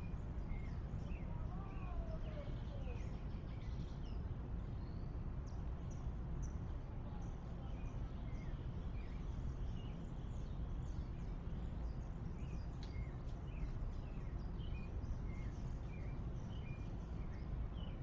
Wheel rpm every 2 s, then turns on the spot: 0, 0, 0, 0, 0, 0, 0, 0, 0.
none